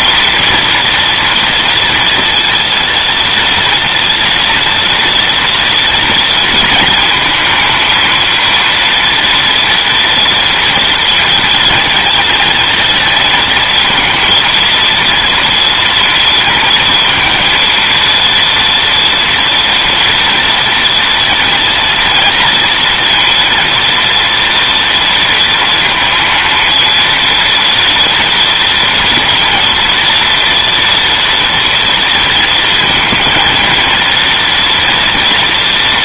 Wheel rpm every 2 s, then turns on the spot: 230, 230, 230, 230, 230, 230, 220, 230, 230, 230, 230, 230, 230, 230, 230, 230, 220, 230.
none